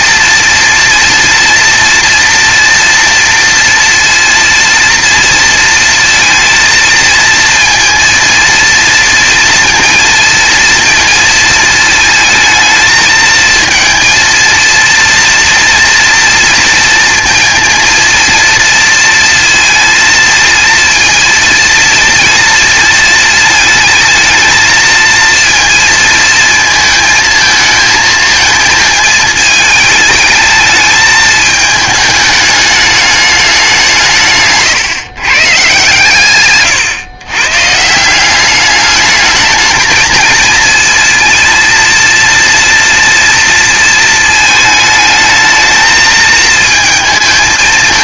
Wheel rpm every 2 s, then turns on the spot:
230, 230, 230, 220, 230, 230, 220, 230, 230, 230, 230, 230, 230, 220, 220, 220, 210, 130, 130, 210, 230, 230, 220, 220.
none